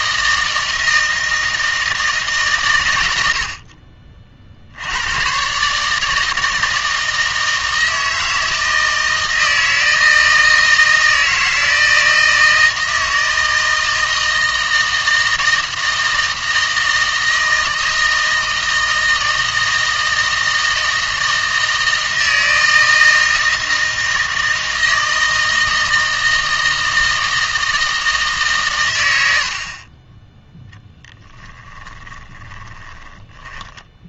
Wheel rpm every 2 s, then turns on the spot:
160, 130, 60, 160, 160, 160, 160, 160, 160, 160, 160, 160, 160, 160, 140, 10, 20.
30-34